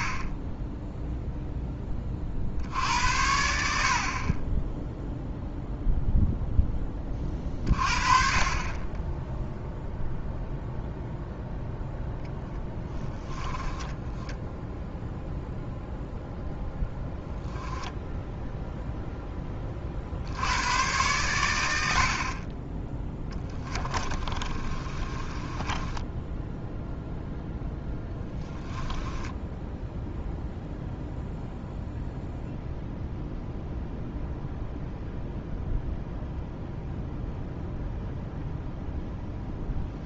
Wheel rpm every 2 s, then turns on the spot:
0, 60, 10, 10, 20, 0, 10, 10, 0, 0, 100, 10, 30, 0, 10, 0, 0, 0, 0, 0.
12-14 24-26 28-30